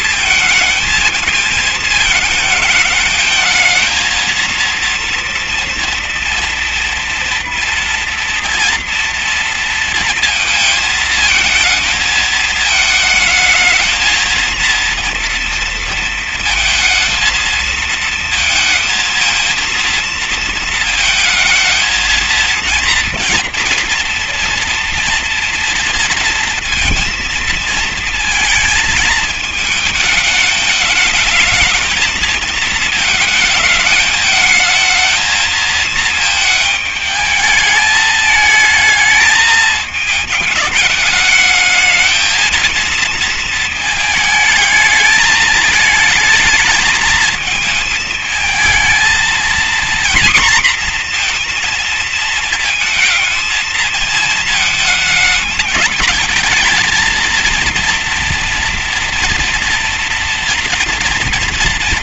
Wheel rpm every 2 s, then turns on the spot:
220, 220, 230, 230, 230, 230, 220, 230, 230, 220, 220, 230, 230, 230, 220, 210, 220, 220, 220, 220, 210, 230, 220, 220, 220, 240, 230, 220, 230, 230, 230.
none